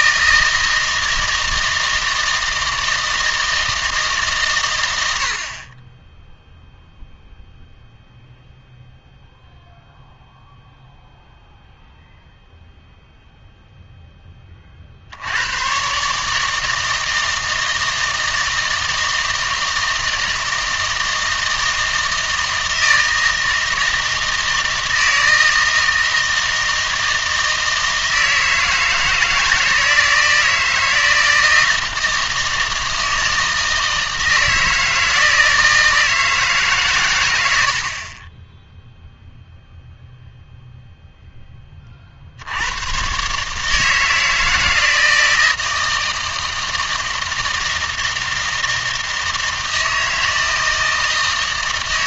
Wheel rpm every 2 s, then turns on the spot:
160, 160, 110, 0, 0, 0, 0, 30, 160, 160, 160, 160, 160, 160, 160, 160, 160, 160, 140, 10, 0, 90, 160, 160, 160, 160.
none